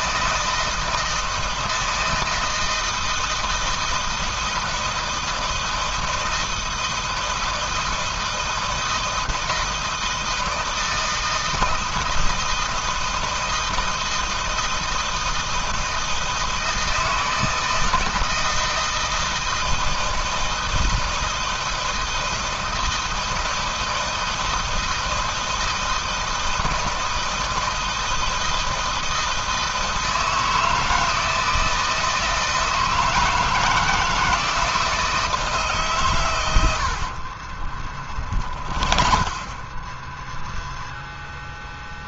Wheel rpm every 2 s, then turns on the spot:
160, 160, 160, 160, 160, 160, 160, 160, 160, 160, 160, 160, 160, 160, 160, 160, 160, 160, 100, 30, 0.
36-40